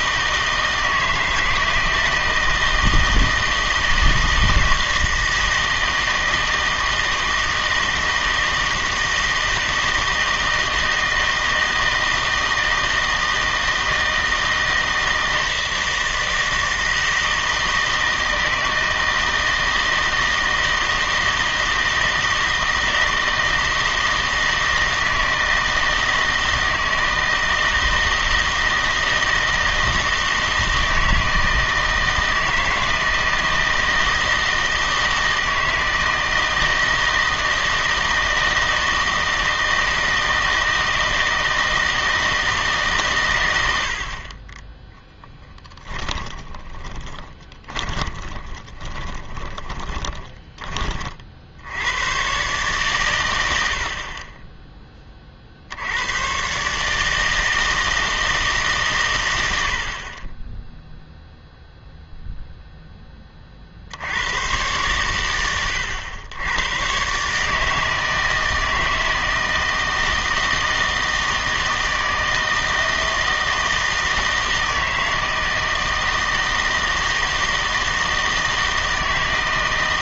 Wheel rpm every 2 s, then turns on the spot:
160, 160, 160, 160, 160, 160, 160, 160, 160, 160, 160, 160, 160, 160, 160, 160, 160, 160, 160, 160, 160, 150, 10, 20, 20, 20, 130, 10, 130, 150, 10, 0, 110, 100, 160, 160, 160, 160, 160, 160.
46-50